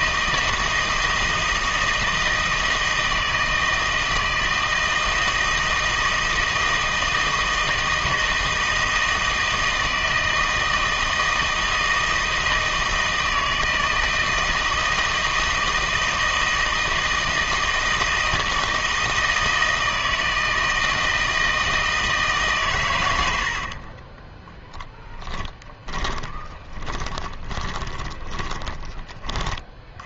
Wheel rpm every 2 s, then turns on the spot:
160, 160, 160, 160, 160, 160, 160, 160, 160, 160, 160, 140, 20, 20, 10.
24-30